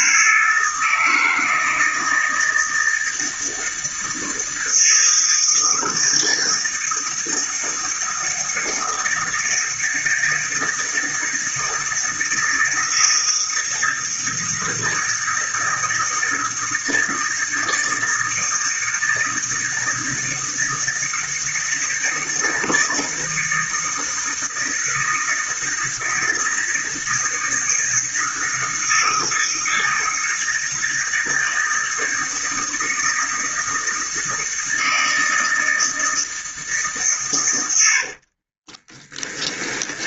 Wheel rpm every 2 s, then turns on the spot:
160, 160, 160, 160, 160, 160, 160, 160, 160, 160, 160, 160, 160, 160, 160, 160, 160, 160, 150, 20.
38-40